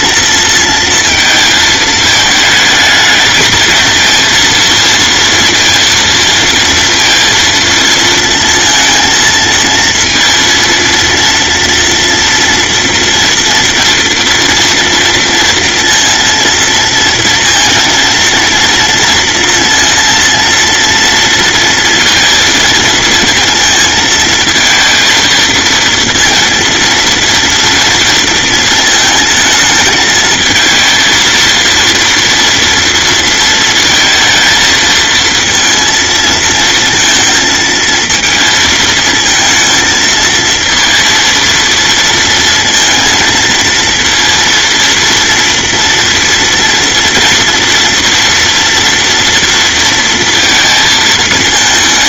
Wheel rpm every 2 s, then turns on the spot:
230, 220, 230, 230, 230, 230, 230, 230, 230, 230, 230, 220, 230, 230, 230, 220, 230, 230, 230, 220, 230, 230, 230, 230, 230, 230.
none